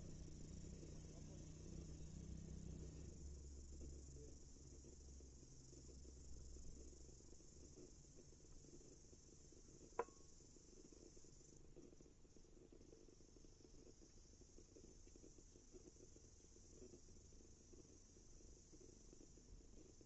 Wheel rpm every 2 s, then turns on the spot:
0, 0, 0, 0, 0, 0, 0, 0, 0, 0.
none